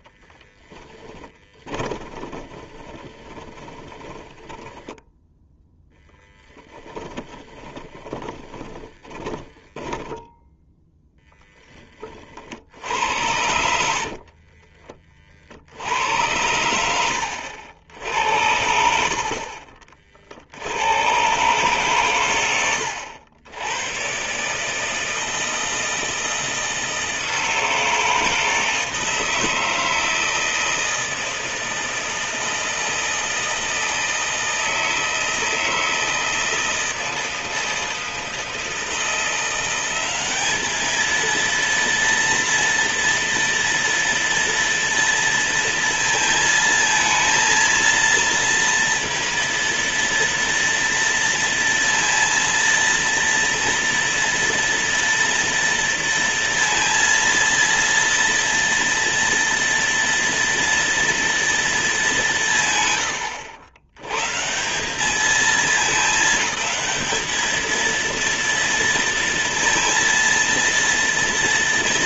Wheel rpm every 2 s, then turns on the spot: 10, 20, 10, 20, 30, 10, 60, 30, 90, 70, 80, 90, 140, 160, 160, 160, 160, 160, 160, 160, 210, 230, 230, 230, 230, 230, 230, 230, 230, 230, 230, 150, 160, 210, 230, 230.
0-10 14-16